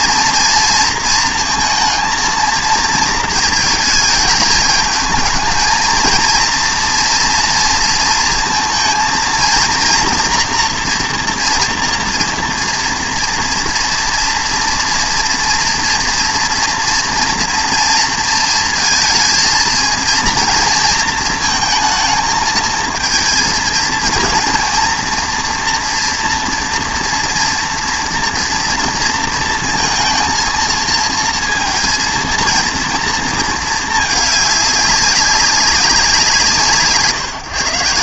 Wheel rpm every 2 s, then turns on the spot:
230, 230, 220, 230, 230, 240, 240, 230, 230, 230, 230, 230, 230, 230, 230, 220, 230, 200, 140.
none